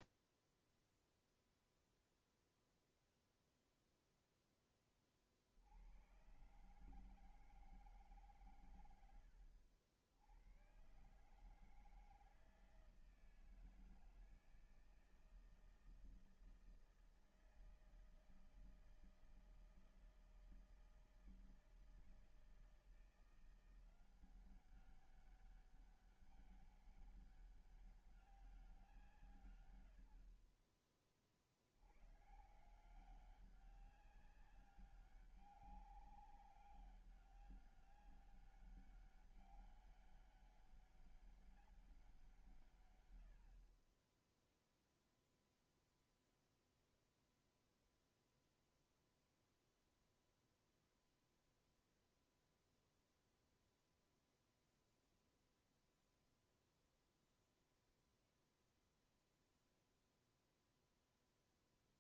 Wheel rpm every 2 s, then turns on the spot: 0, 0, 0, 110, 130, 100, 160, 160, 160, 160, 160, 160, 180, 200, 200, 60, 110, 190, 200, 200, 200, 170, 20, 0, 0, 0, 0, 0, 0, 0, 0.
none